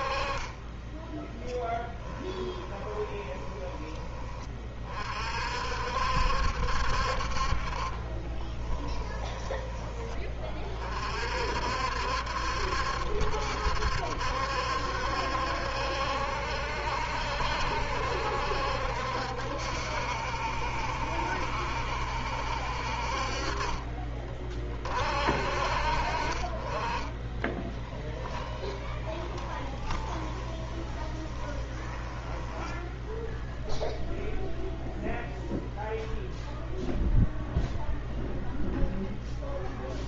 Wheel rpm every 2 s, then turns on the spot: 20, 20, 40, 60, 10, 40, 70, 70, 70, 60, 70, 60, 60, 20, 20, 20, 10, 0, 0, 0.
0-4 8-10 26-34